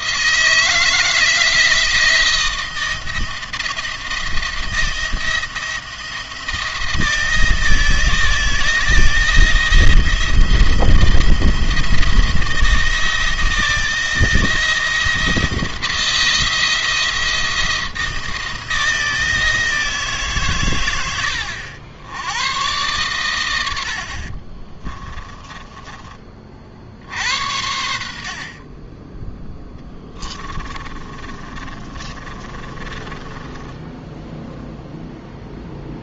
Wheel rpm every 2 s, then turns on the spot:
160, 170, 160, 160, 170, 170, 160, 170, 170, 170, 120, 100, 40, 50, 30, 20, 30, 0.
24-26 30-34